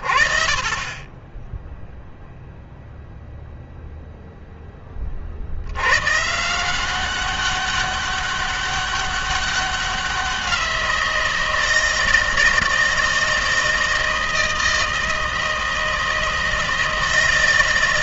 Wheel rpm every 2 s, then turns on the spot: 70, 0, 10, 160, 200, 180, 160, 160, 160.
none